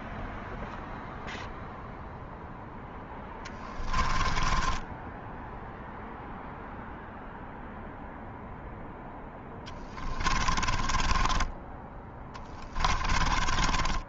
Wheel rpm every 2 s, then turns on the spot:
0, 10, 10, 0, 10, 30, 20.
2-6 8-14